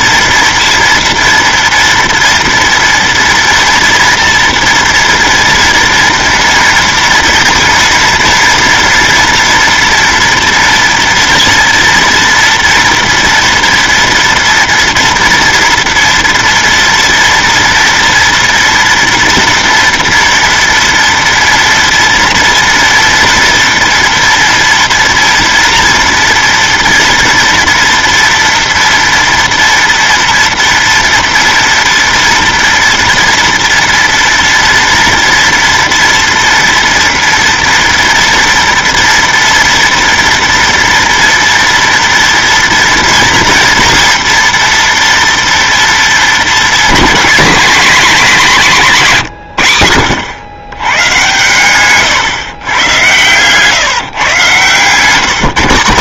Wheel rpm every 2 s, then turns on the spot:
230, 230, 240, 230, 230, 240, 230, 230, 230, 230, 230, 230, 230, 230, 230, 230, 230, 230, 230, 230, 230, 230, 230, 210, 200, 110, 120, 130.
none